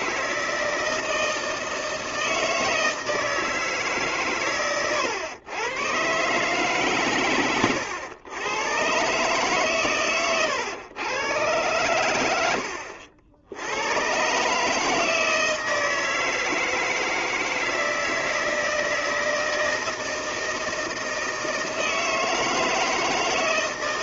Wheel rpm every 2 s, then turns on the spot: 160, 160, 130, 140, 110, 110, 100, 140, 160, 160, 160, 160.
none